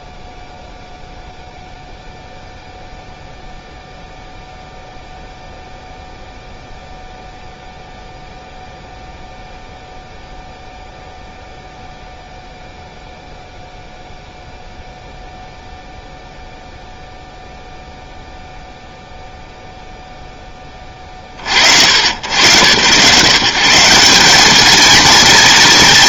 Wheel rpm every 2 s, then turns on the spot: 0, 0, 0, 0, 0, 0, 0, 0, 0, 0, 30, 140, 230.
none